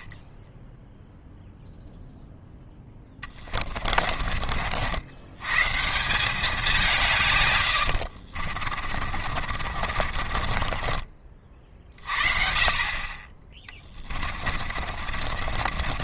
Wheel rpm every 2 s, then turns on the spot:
10, 10, 60, 190, 40, 30, 50, 40.
8-12 14-16